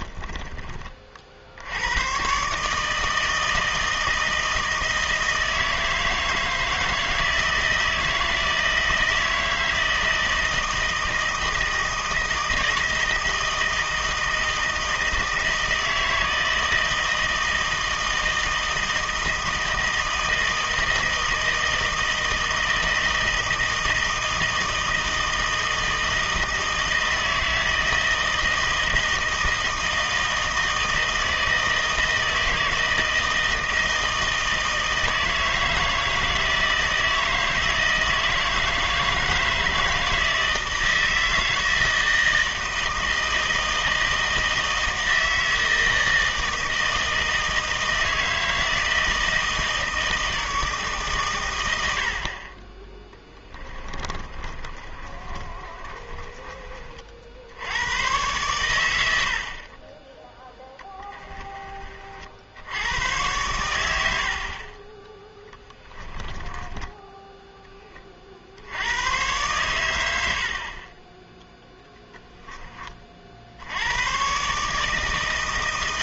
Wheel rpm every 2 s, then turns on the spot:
20, 140, 160, 160, 160, 160, 160, 160, 160, 160, 160, 160, 160, 160, 160, 160, 160, 160, 160, 160, 160, 160, 160, 160, 160, 160, 30, 30, 30, 110, 10, 80, 40, 20, 70, 50, 10, 140.
0-2 54-56 60-62 64-68 70-72